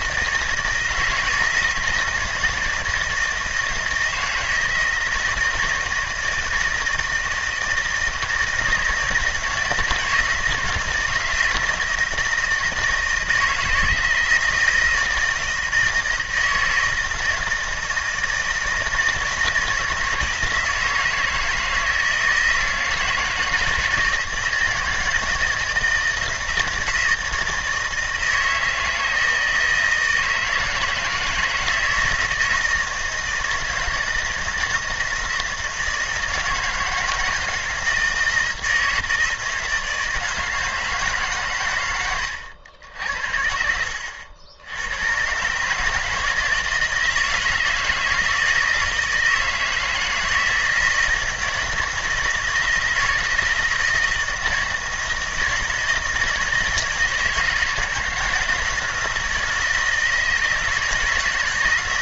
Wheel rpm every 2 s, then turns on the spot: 160, 160, 170, 160, 160, 160, 160, 170, 160, 160, 160, 160, 160, 160, 160, 160, 160, 160, 160, 160, 160, 90, 90, 160, 160, 160, 160, 160, 160, 160, 160.
none